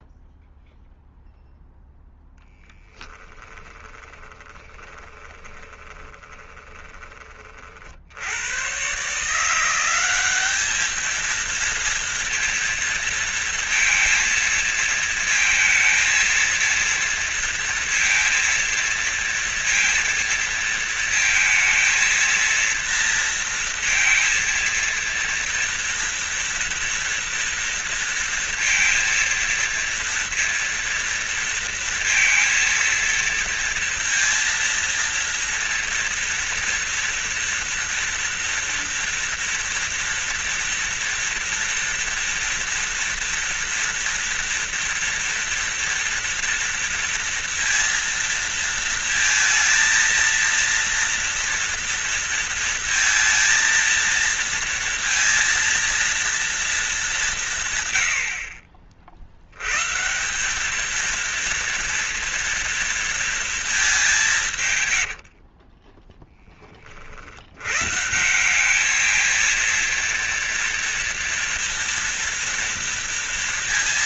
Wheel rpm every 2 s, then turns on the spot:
0, 10, 20, 20, 130, 210, 230, 230, 230, 230, 230, 230, 230, 230, 230, 230, 230, 230, 230, 230, 230, 230, 230, 230, 230, 230, 230, 230, 220, 50, 220, 230, 130, 30, 210, 230, 230.
2-8